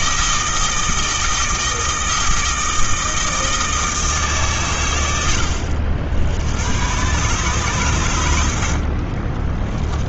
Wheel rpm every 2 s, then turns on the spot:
160, 160, 120, 100, 50.
none